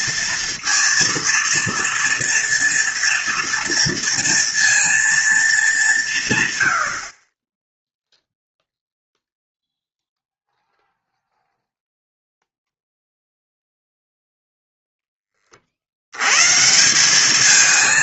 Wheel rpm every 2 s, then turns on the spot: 230, 230, 230, 60, 0, 0, 0, 10, 180.
none